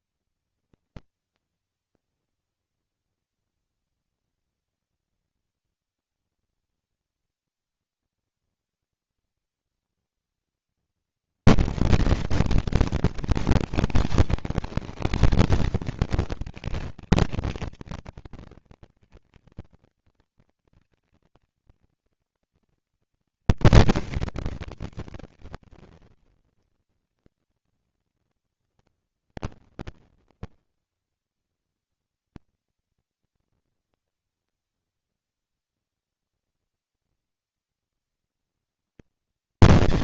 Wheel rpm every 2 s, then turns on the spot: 230, 230, 230, 230, 230, 230, 230, 230, 230, 230, 230, 230, 230, 230, 230, 240, 230, 240, 230, 230.
none